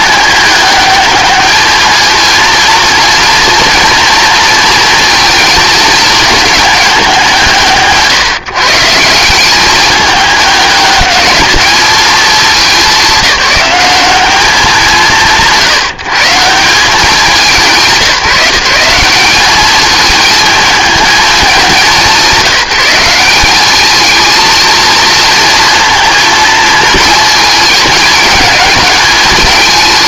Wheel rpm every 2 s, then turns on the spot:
210, 230, 230, 200, 170, 210, 200, 180, 180, 190, 210, 180, 230, 220, 210.
none